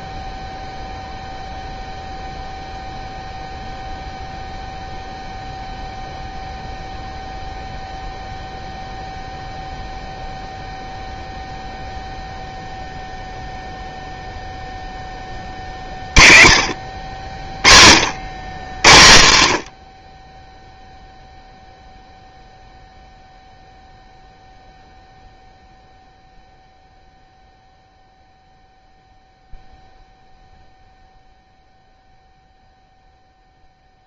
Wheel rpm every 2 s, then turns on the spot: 0, 0, 0, 0, 0, 0, 0, 0, 50, 120, 0, 0, 0, 0, 0, 0, 0.
none